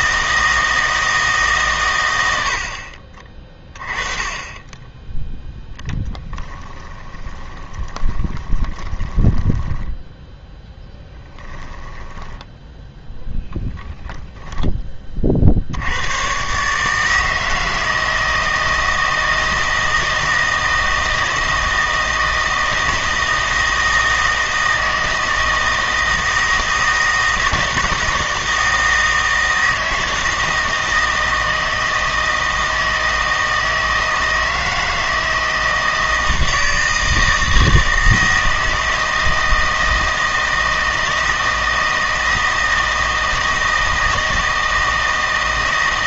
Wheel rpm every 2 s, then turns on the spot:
160, 70, 20, 20, 20, 10, 10, 20, 150, 160, 160, 160, 160, 160, 160, 160, 160, 160, 160, 160, 160, 160, 160.
6-14